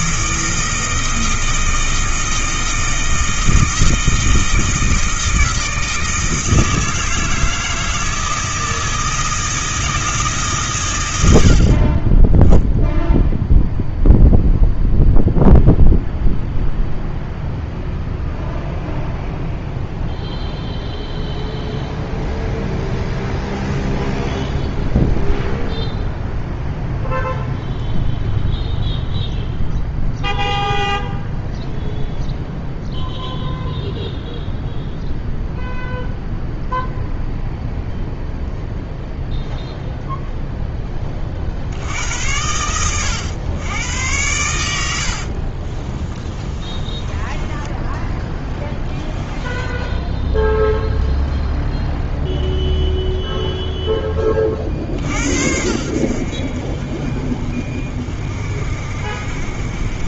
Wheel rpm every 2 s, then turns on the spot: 160, 160, 160, 160, 160, 120, 0, 0, 0, 0, 0, 0, 0, 0, 0, 0, 0, 0, 0, 0, 10, 100, 80, 20, 10, 0, 0, 50, 50, 50.
46-50